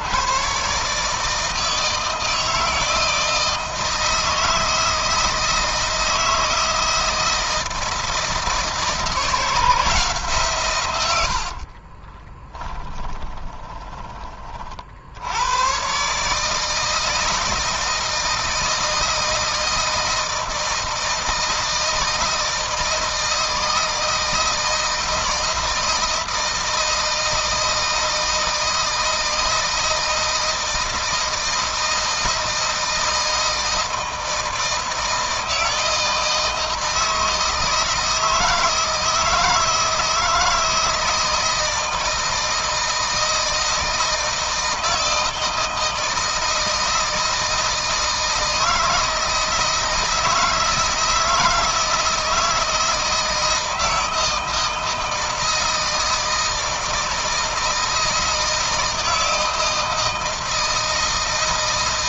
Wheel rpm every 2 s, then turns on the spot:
130, 160, 160, 160, 160, 110, 10, 40, 160, 160, 160, 160, 160, 160, 160, 160, 160, 160, 160, 160, 160, 160, 160, 160, 160, 160, 160, 160, 160, 160, 160.
12-14